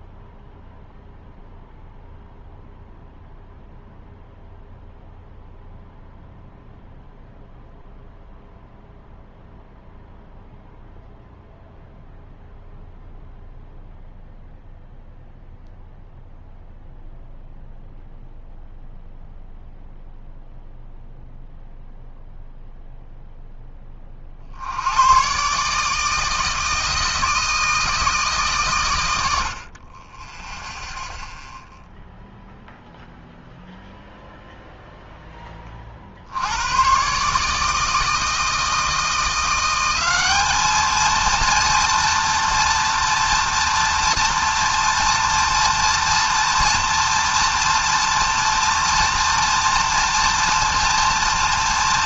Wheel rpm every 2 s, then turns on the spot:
0, 0, 0, 0, 0, 0, 0, 0, 0, 0, 0, 0, 60, 160, 140, 0, 0, 0, 90, 160, 210, 230, 230, 230, 230, 230.
none